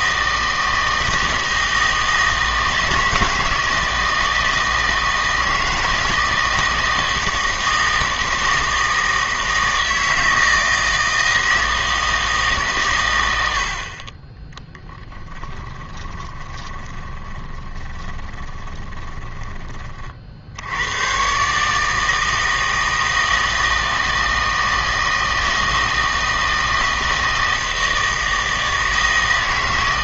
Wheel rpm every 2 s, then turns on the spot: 160, 160, 160, 160, 160, 160, 130, 20, 20, 20, 100, 160, 160, 160, 160.
14-20